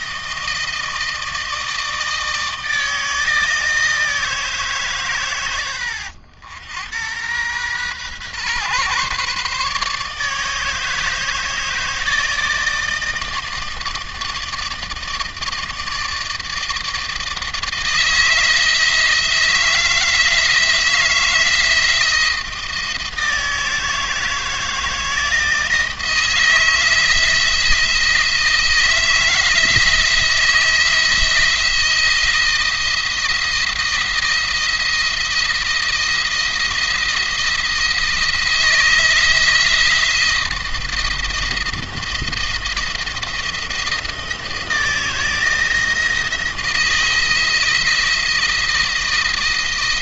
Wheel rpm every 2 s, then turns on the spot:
160, 160, 140, 90, 130, 160, 160, 160, 160, 160, 160, 160, 160, 160, 160, 160, 160, 170, 170, 170, 170, 170, 160, 160, 170.
none